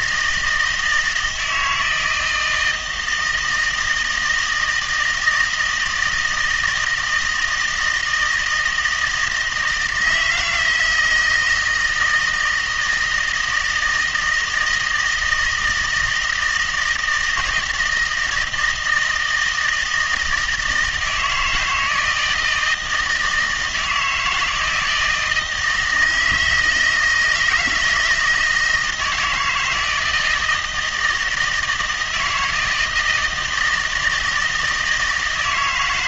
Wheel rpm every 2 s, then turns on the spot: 160, 160, 160, 160, 160, 160, 160, 160, 160, 160, 160, 160, 170, 160, 160, 160, 160, 160.
none